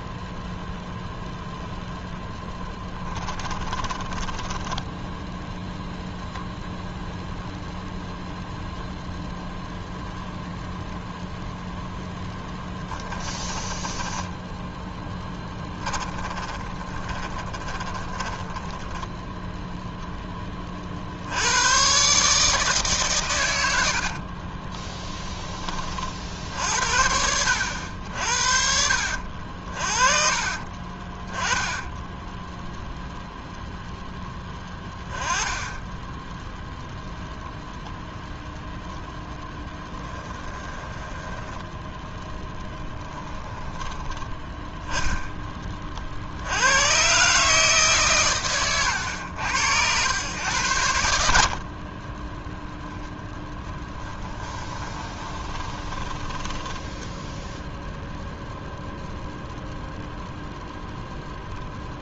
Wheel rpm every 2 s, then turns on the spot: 0, 10, 10, 0, 0, 0, 10, 10, 20, 10, 30, 140, 30, 60, 60, 40, 0, 10, 0, 0, 10, 10, 10, 80, 120, 100, 0, 10, 20, 0, 0.
2-6 12-20 24-26 30-32 40-44 54-58